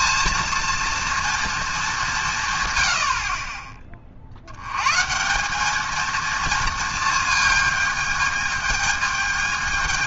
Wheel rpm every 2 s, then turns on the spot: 230, 50, 170, 220, 220.
none